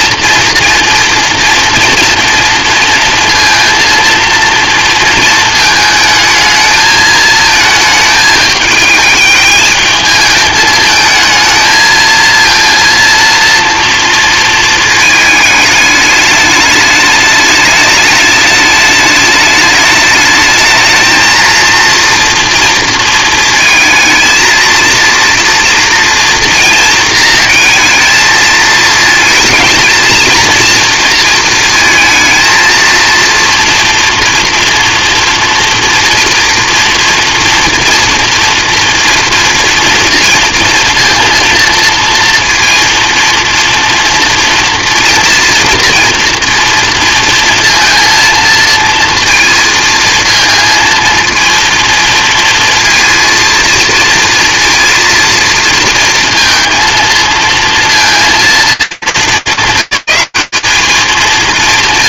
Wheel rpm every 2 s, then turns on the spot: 230, 230, 230, 220, 210, 220, 230, 230, 210, 210, 220, 230, 230, 230, 230, 230, 230, 230, 240, 240, 230, 230, 230, 230, 230, 230, 230, 230, 230, 210, 210.
none